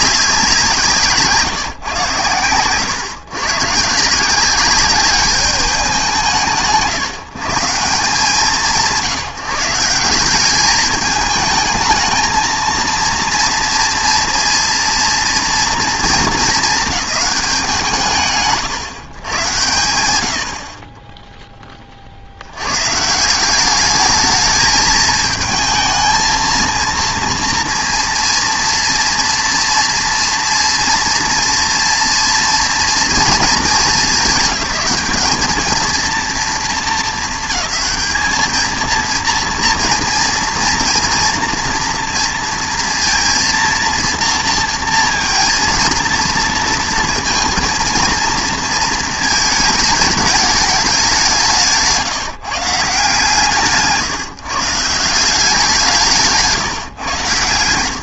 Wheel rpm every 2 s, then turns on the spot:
180, 110, 190, 150, 160, 190, 230, 230, 210, 140, 70, 90, 220, 230, 230, 240, 230, 190, 230, 220, 230, 230, 230, 230, 230, 210, 150, 150, 150.
none